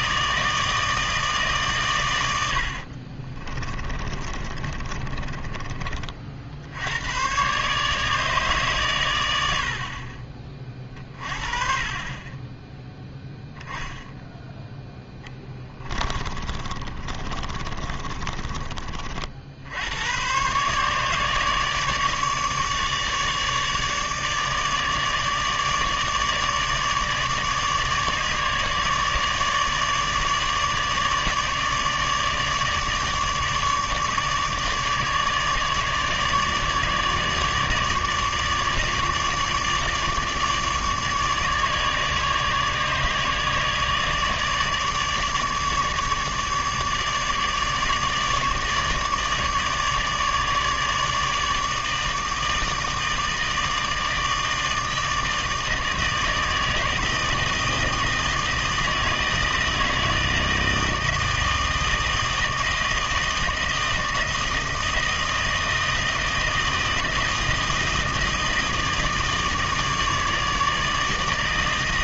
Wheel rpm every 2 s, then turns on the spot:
160, 80, 30, 70, 130, 30, 10, 10, 30, 30, 130, 150, 150, 150, 150, 150, 150, 150, 150, 150, 150, 150, 150, 150, 150, 150, 160, 160, 160, 160, 160, 160, 160, 160, 160, 160.
2-6 16-18